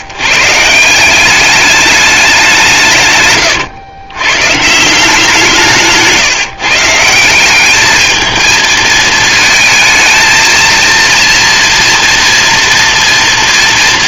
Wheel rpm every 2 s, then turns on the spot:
130, 190, 130, 150, 220, 220, 230.
none